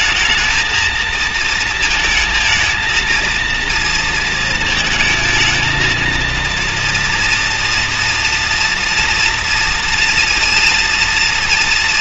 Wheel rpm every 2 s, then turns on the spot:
220, 230, 220, 230, 230, 230.
none